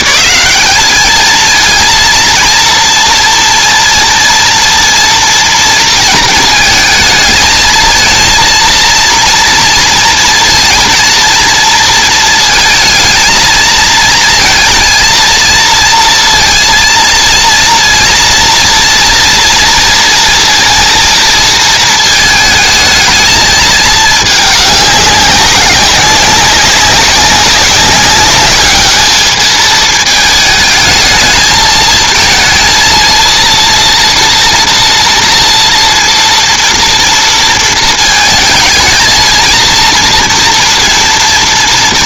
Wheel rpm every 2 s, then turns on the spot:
220, 230, 230, 220, 230, 240, 220, 230, 230, 230, 230, 220, 200, 200, 210, 220, 230, 230, 230, 220, 230.
none